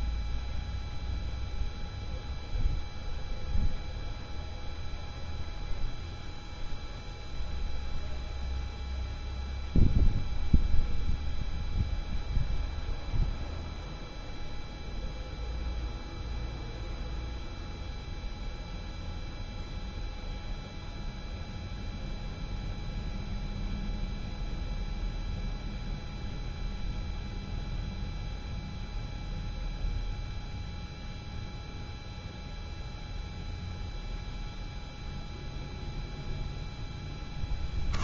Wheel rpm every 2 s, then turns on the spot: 0, 0, 0, 0, 0, 0, 0, 0, 0, 0, 0, 0, 0, 0, 0, 0, 0, 0, 0.
none